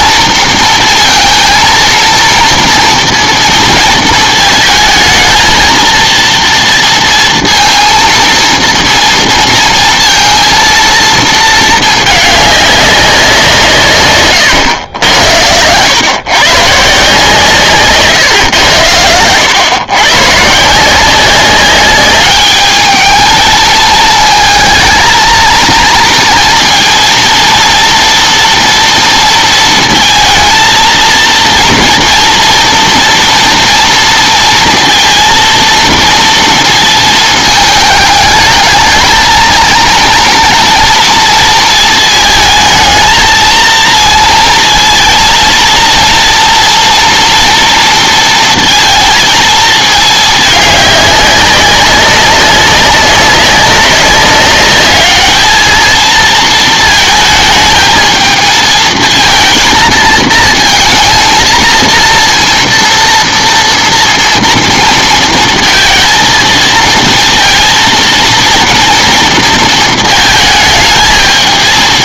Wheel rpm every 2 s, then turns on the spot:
230, 230, 220, 230, 230, 230, 200, 110, 140, 110, 150, 210, 220, 230, 230, 230, 230, 230, 230, 210, 230, 220, 230, 230, 230, 210, 190, 200, 220, 220, 230, 230, 230, 230, 230, 220.
none